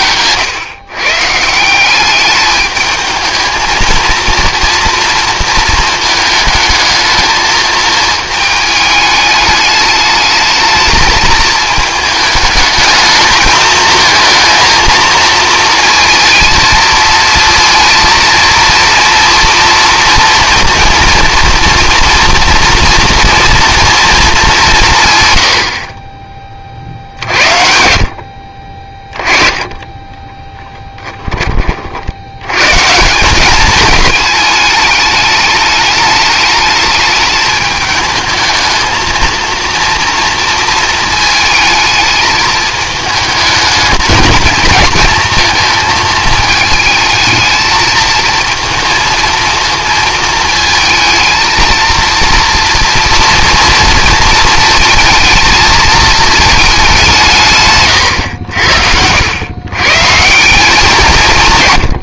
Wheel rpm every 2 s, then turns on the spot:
130, 210, 230, 220, 210, 220, 210, 220, 230, 230, 230, 230, 200, 40, 40, 10, 110, 210, 210, 220, 230, 220, 220, 220, 230, 220, 230, 230, 220, 80, 180.
30-32 58-60